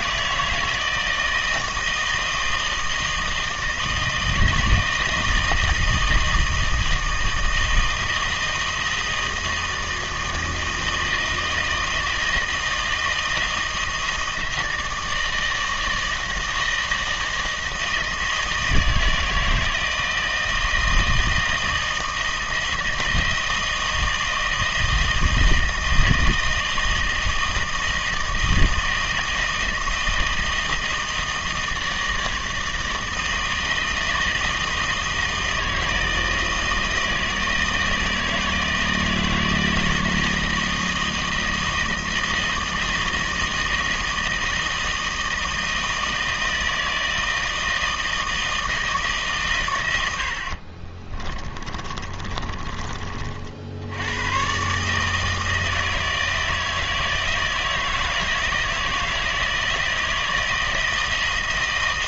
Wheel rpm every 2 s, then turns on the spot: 160, 160, 160, 160, 160, 160, 160, 160, 170, 160, 160, 160, 160, 160, 160, 160, 160, 160, 160, 160, 160, 160, 160, 160, 160, 50, 30, 140, 160, 160, 160.
50-52